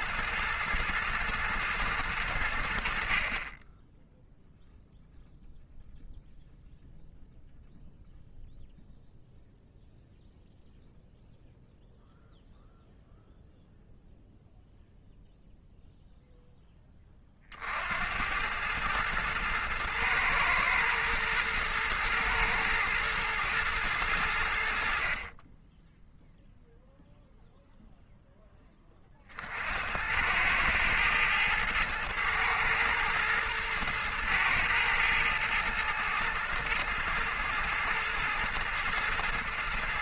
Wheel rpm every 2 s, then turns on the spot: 110, 60, 0, 0, 0, 0, 0, 0, 10, 110, 110, 110, 60, 0, 30, 110, 110, 110, 110, 110.
none